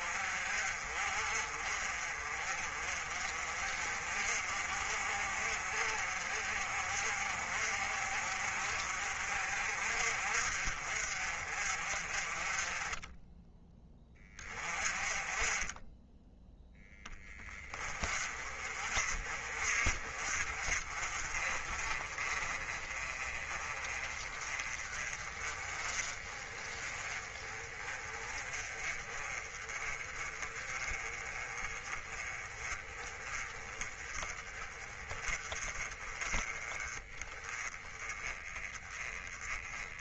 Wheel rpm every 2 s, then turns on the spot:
50, 40, 50, 50, 50, 50, 20, 30, 10, 40, 40, 30, 30, 30, 30, 30, 20, 30, 20, 20.
none